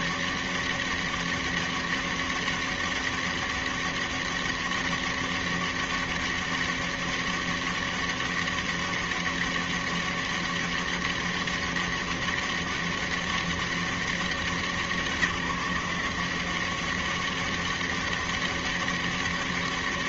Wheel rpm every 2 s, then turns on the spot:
200, 200, 200, 200, 200, 200, 200, 180, 190, 200.
none